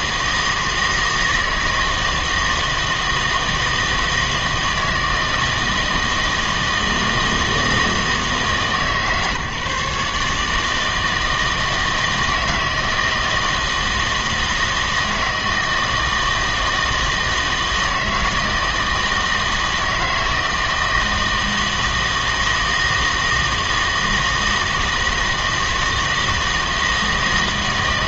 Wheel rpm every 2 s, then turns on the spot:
160, 160, 160, 160, 150, 150, 160, 160, 160, 160, 160, 160, 160, 160.
none